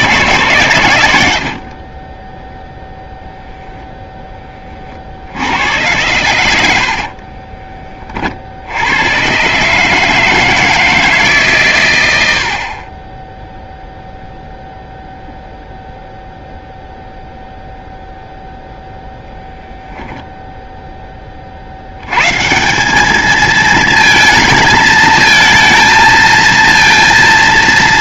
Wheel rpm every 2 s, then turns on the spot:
100, 0, 50, 50, 100, 160, 30, 0, 0, 0, 10, 190, 220, 230.
6-8